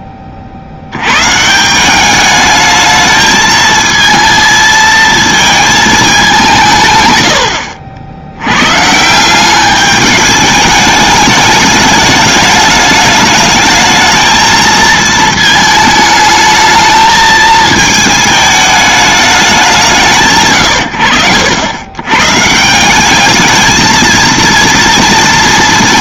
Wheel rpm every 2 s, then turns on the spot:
60, 210, 220, 170, 100, 210, 210, 220, 220, 220, 120, 150, 230.
none